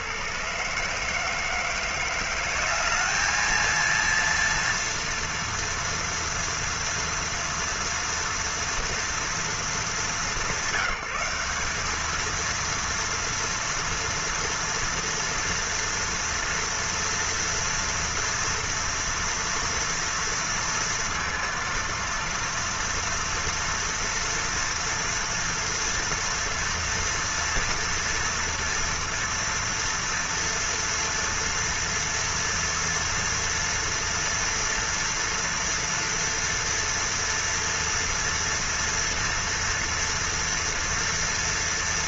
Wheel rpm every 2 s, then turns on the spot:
120, 190, 230, 230, 230, 170, 230, 230, 240, 230, 230, 230, 230, 230, 230, 230, 230, 230, 230, 230, 230.
none